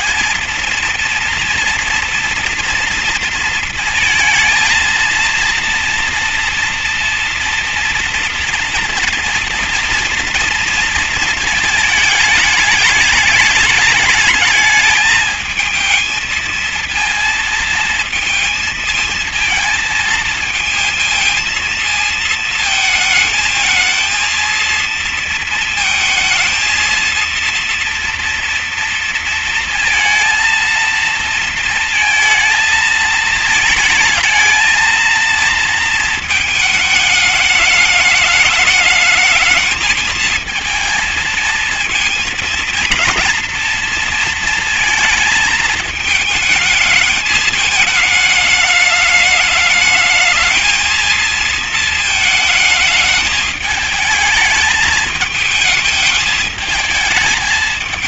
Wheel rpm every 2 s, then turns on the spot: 220, 230, 220, 230, 230, 230, 220, 220, 230, 220, 230, 230, 230, 230, 230, 230, 220, 220, 220, 210, 220, 230, 230, 220, 210, 220, 220, 220, 220.
none